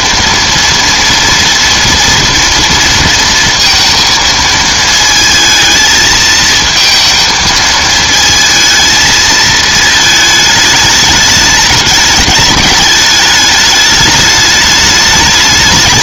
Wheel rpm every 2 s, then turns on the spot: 230, 230, 220, 220, 220, 220, 210, 210.
none